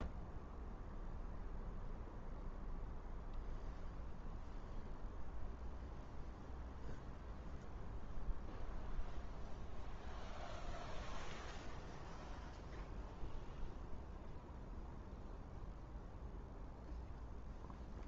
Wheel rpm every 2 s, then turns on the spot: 0, 0, 0, 0, 0, 0, 0, 0, 0.
none